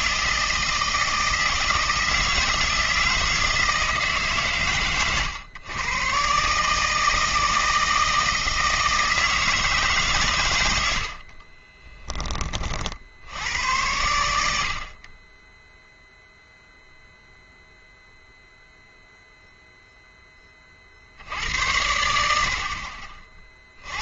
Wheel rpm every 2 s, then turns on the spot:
160, 160, 120, 150, 160, 90, 50, 60, 0, 0, 50, 50.
none